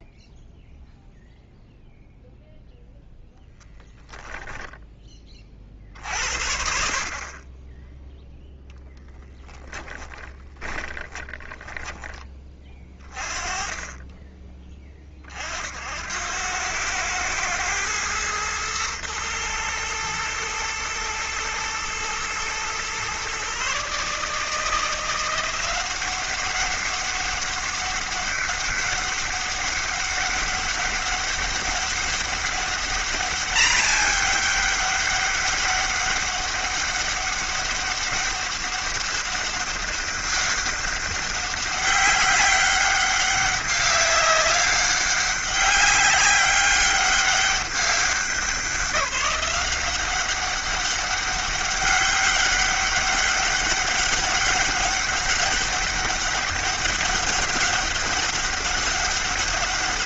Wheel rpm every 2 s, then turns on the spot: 0, 0, 10, 60, 0, 20, 20, 20, 90, 110, 120, 120, 160, 190, 200, 200, 200, 210, 200, 200, 200, 200, 200, 200, 180, 190, 200, 200, 200, 200.
10-12